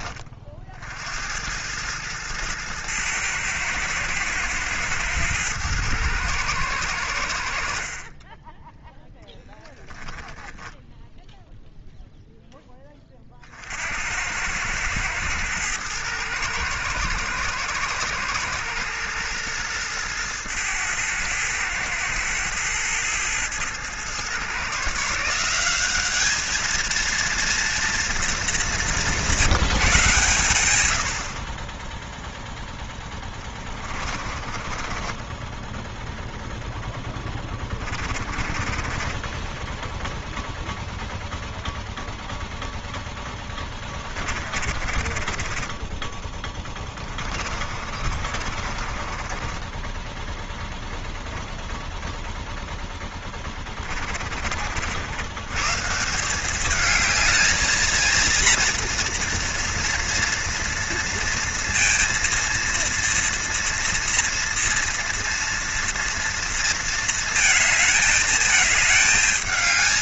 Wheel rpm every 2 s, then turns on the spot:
50, 110, 110, 100, 10, 10, 10, 100, 110, 110, 110, 110, 130, 220, 200, 100, 0, 30, 0, 20, 0, 0, 40, 20, 40, 0, 0, 40, 200, 230, 230, 230, 230, 230, 220.
34-36 38-40 44-50